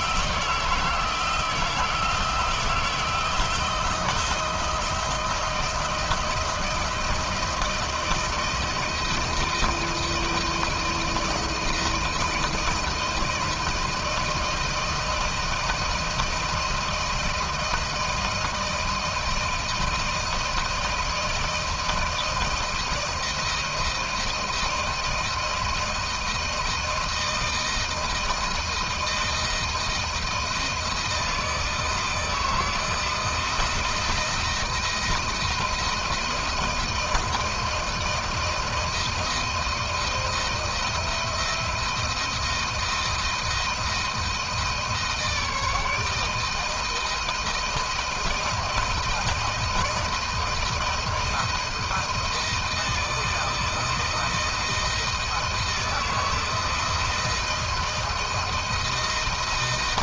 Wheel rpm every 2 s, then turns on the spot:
160, 170, 160, 160, 160, 170, 160, 160, 160, 170, 170, 170, 160, 160, 160, 160, 160, 170, 160, 170, 170, 160, 160, 160, 160, 160, 160, 160, 160, 160.
none